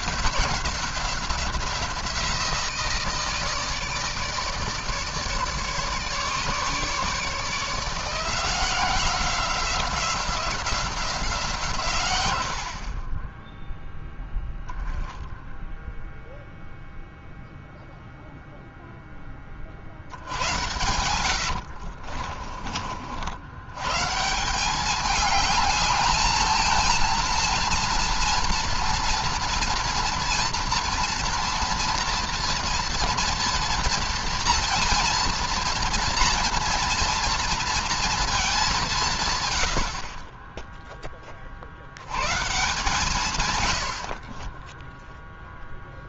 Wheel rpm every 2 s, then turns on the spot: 180, 170, 150, 150, 180, 180, 40, 0, 0, 10, 100, 60, 200, 230, 230, 230, 230, 230, 230, 180, 10, 150, 10.
20-22